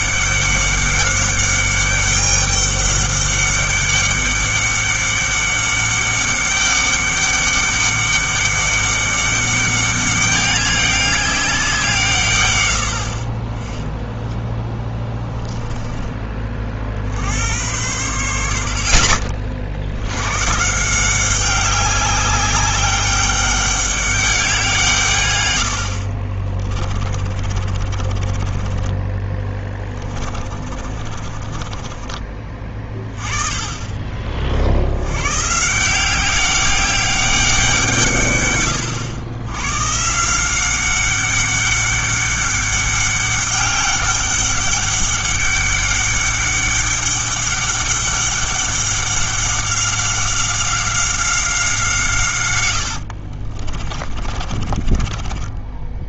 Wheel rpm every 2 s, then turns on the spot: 200, 200, 200, 200, 200, 200, 110, 10, 40, 70, 160, 200, 180, 30, 20, 30, 30, 70, 200, 120, 180, 200, 200, 200, 200, 190, 90, 30.
14-16 26-32 52-56